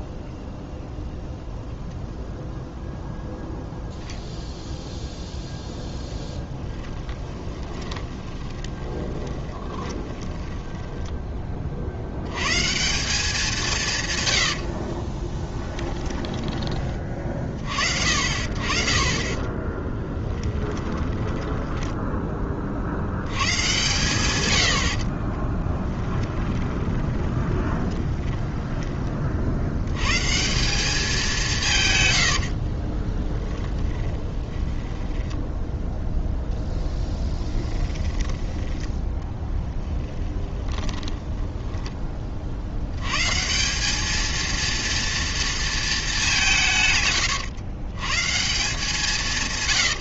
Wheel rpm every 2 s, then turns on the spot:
0, 0, 0, 10, 20, 20, 130, 70, 20, 50, 20, 30, 100, 20, 10, 170, 60, 10, 0, 10, 20, 60, 230, 170, 170.
6-12 20-22 26-30 32-36 40-42